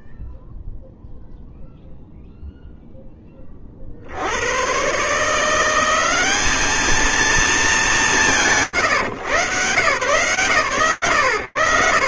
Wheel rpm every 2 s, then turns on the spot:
0, 50, 180, 210, 130, 70.
none